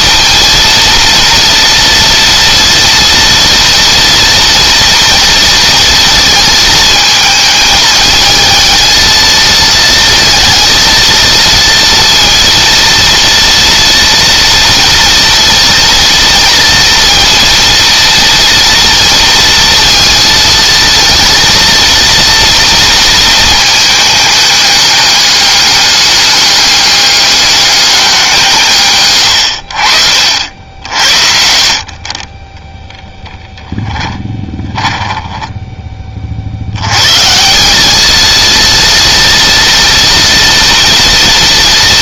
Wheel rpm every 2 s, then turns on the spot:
230, 240, 240, 220, 220, 230, 230, 230, 230, 230, 230, 230, 210, 210, 130, 60, 10, 10, 80, 230, 230.
28-30 34-36